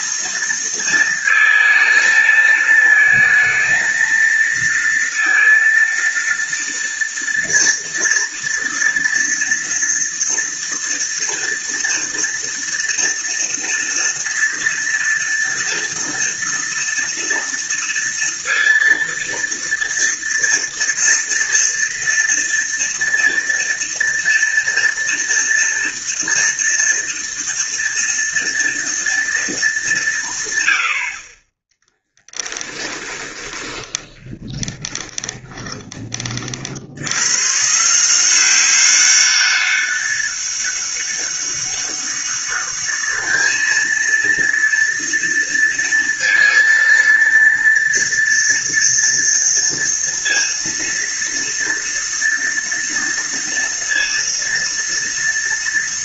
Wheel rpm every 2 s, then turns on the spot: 230, 220, 230, 230, 230, 230, 230, 230, 230, 230, 230, 230, 230, 230, 230, 30, 20, 20, 120, 200, 200, 210, 230, 230, 230, 230, 230, 230.
32-36